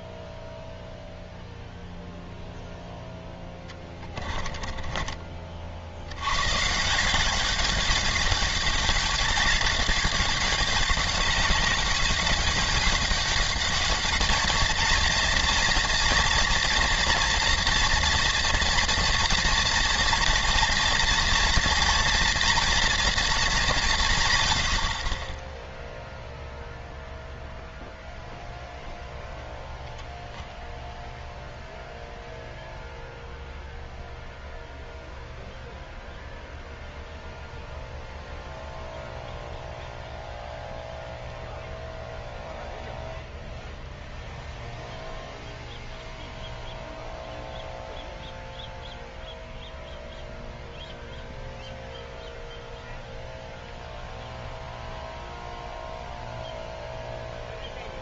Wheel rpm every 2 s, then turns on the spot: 0, 0, 20, 150, 210, 200, 200, 230, 230, 230, 230, 230, 70, 0, 0, 0, 0, 0, 0, 0, 0, 0, 0, 0, 0, 0, 0, 0, 0.
4-6